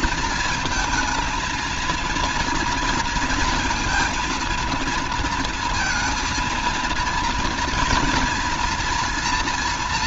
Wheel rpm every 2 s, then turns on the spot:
220, 230, 230, 230, 230.
none